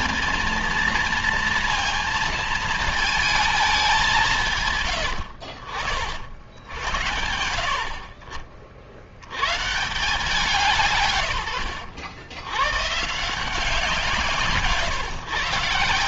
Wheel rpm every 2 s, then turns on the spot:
220, 220, 140, 80, 40, 160, 110, 160.
none